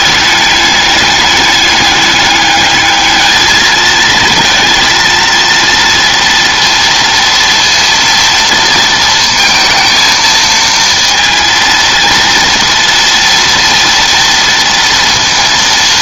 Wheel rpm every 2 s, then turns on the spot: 210, 210, 220, 230, 230, 230, 230, 230.
none